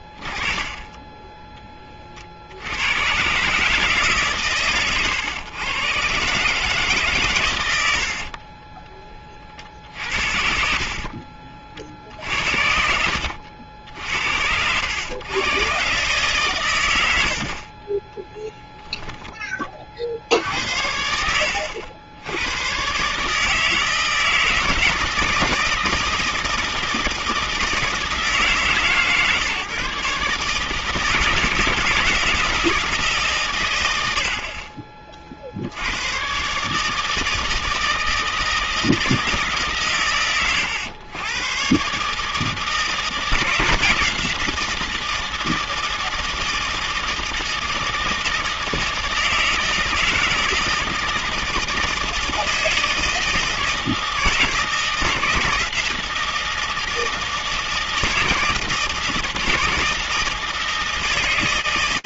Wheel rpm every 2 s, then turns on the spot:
20, 80, 120, 150, 30, 60, 60, 80, 120, 10, 70, 110, 160, 160, 150, 150, 160, 50, 150, 160, 110, 160, 170, 160, 160, 160, 160, 160, 160, 160, 160.
0-2 8-10 12-14